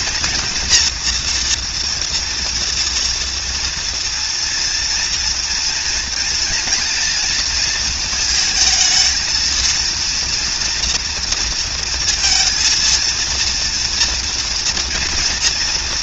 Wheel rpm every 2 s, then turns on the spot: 230, 230, 230, 230, 220, 230, 230, 240.
none